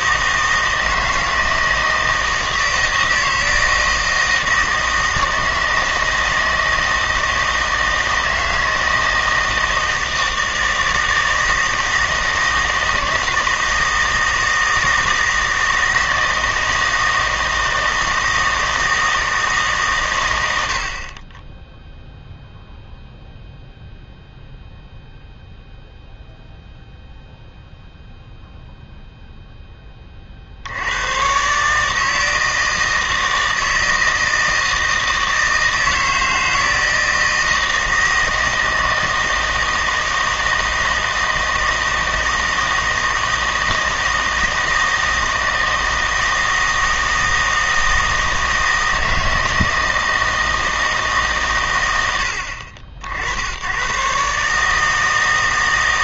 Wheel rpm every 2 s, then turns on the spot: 160, 160, 160, 160, 160, 160, 160, 160, 160, 160, 80, 0, 0, 0, 0, 80, 160, 160, 160, 160, 160, 160, 160, 160, 160, 160, 60, 150.
none